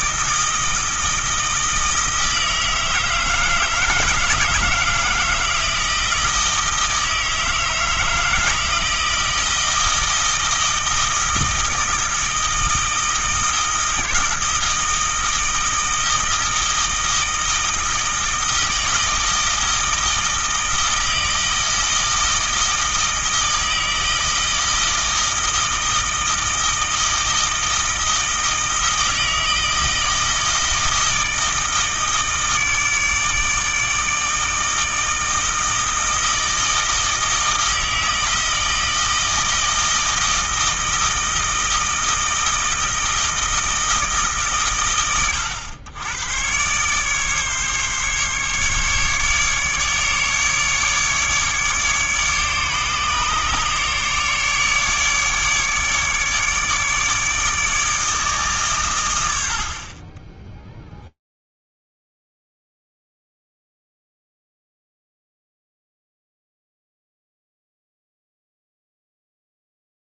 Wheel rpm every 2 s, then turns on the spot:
160, 160, 170, 160, 160, 160, 160, 160, 160, 160, 160, 160, 160, 160, 160, 160, 150, 160, 160, 160, 160, 160, 110, 140, 140, 150, 150, 150, 150, 110, 40, 0, 0, 0, 0.
none